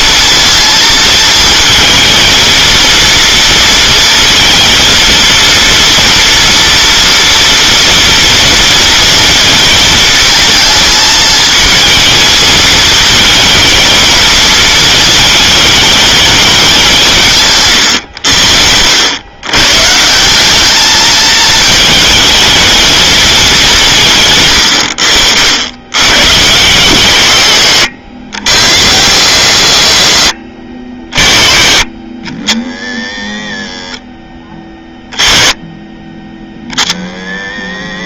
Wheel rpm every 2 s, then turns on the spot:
230, 230, 230, 230, 230, 220, 220, 220, 170, 90, 210, 220, 80, 130, 90, 30, 80, 20, 60.
none